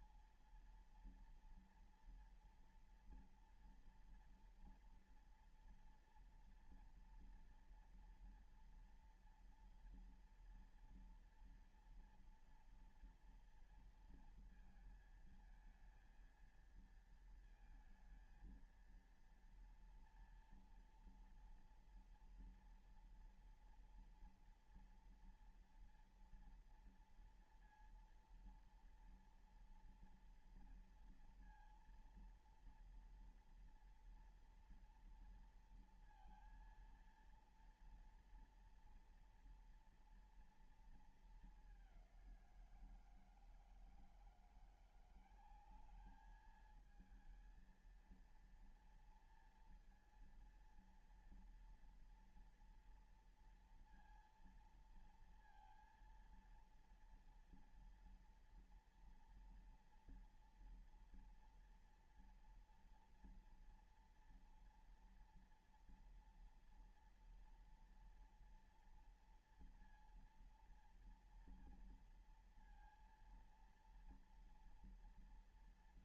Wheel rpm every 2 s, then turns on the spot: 230, 230, 230, 230, 230, 230, 230, 220, 230, 230, 230, 230, 230, 230, 230, 230, 230, 230, 230, 240, 230, 170, 180, 220, 230, 230, 230, 230, 230, 230, 230, 230, 230, 230, 240, 230, 230, 240.
none